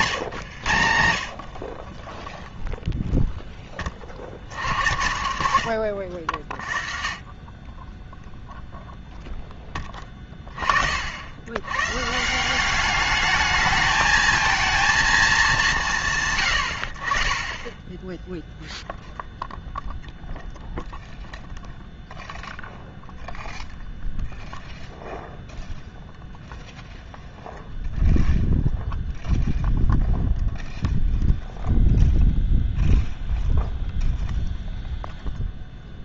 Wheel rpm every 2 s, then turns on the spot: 120, 0, 70, 40, 0, 30, 180, 220, 90, 0, 0, 0, 0, 0, 0, 0, 0, 0.
none